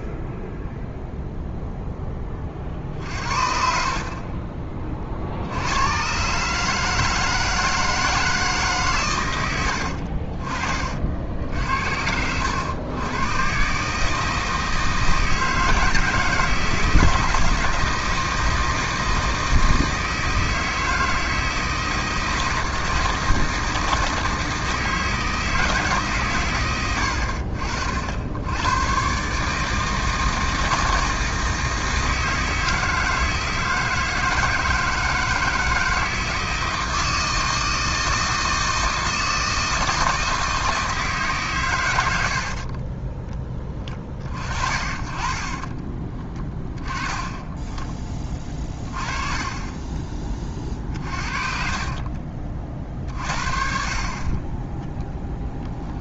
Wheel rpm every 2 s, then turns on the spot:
0, 40, 30, 140, 150, 40, 100, 160, 160, 160, 160, 160, 160, 120, 100, 160, 160, 160, 160, 160, 160, 50, 40, 20, 20, 30, 40, 20.
42-44 48-50